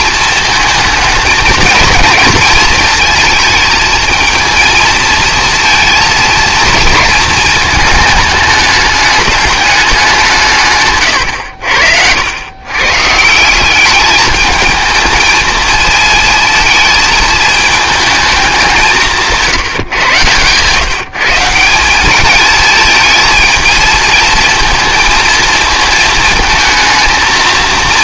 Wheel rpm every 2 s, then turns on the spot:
220, 220, 230, 220, 210, 120, 130, 220, 220, 170, 150, 220, 230, 220.
10-12